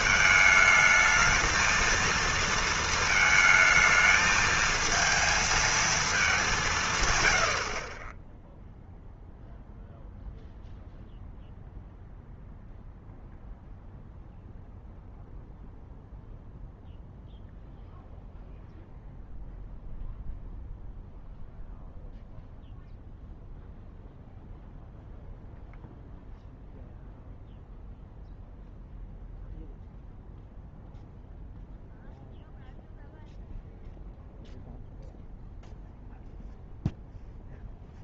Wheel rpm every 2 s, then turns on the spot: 220, 230, 220, 180, 0, 0, 0, 0, 0, 0, 0, 0, 0, 0, 0, 0, 0, 0, 0.
none